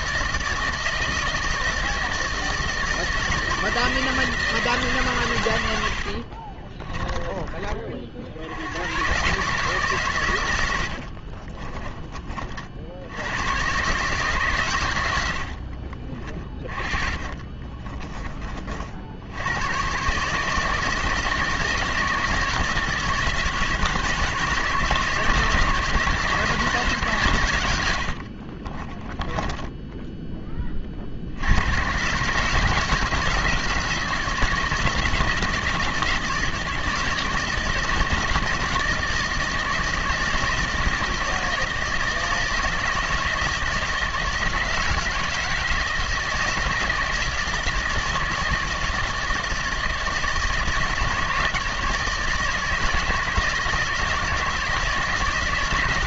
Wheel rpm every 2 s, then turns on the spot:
160, 160, 160, 30, 90, 100, 50, 120, 30, 40, 150, 160, 150, 160, 30, 30, 150, 160, 160, 170, 160, 160, 160, 160, 160, 160, 160, 160.
6-8 16-18 28-30